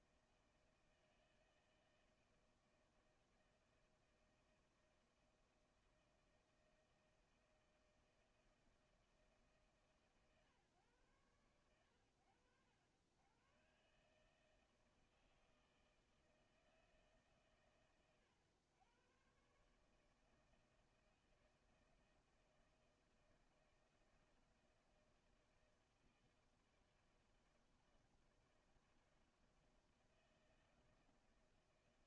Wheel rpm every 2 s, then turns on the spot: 160, 160, 160, 160, 160, 140, 80, 150, 160, 120, 160, 160, 160, 160, 160, 160.
none